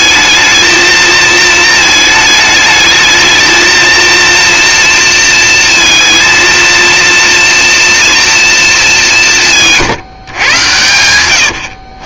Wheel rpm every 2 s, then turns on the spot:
230, 220, 230, 230, 210, 110.
none